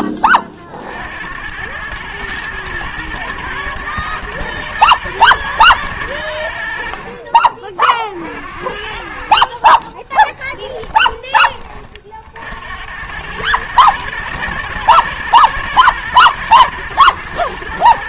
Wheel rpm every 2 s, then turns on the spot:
40, 110, 110, 80, 60, 10, 70, 110, 110.
10-12